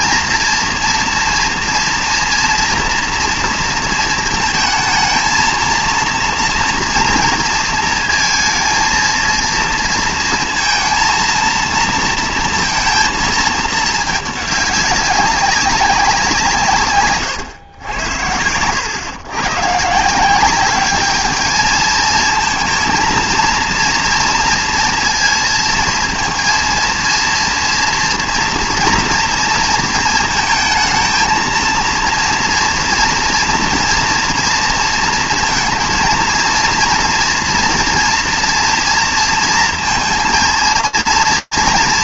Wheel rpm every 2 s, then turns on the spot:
230, 240, 230, 230, 230, 230, 230, 200, 150, 100, 200, 230, 240, 230, 230, 220, 230, 230, 230, 230, 230.
none